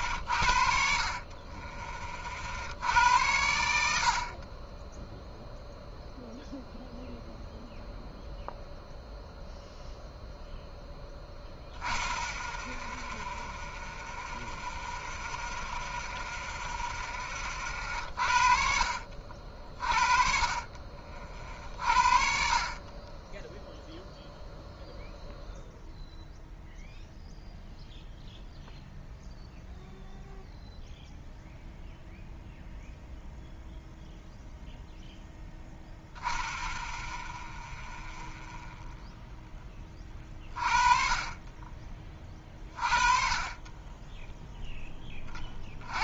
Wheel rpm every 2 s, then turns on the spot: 60, 70, 20, 0, 0, 0, 0, 0, 0, 50, 40, 50, 0, 0, 0, 0, 0, 0, 0, 0, 30, 30, 10.
none